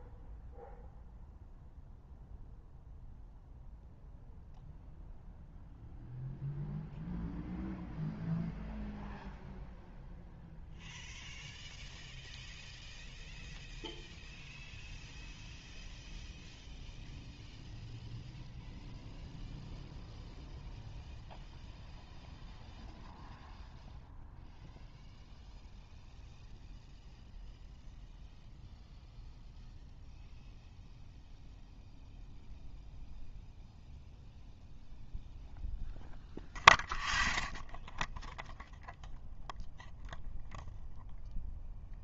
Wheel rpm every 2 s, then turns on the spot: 0, 0, 0, 0, 0, 0, 0, 0, 0, 0, 0, 0, 0, 0, 0, 0, 0, 0, 0, 0, 0.
none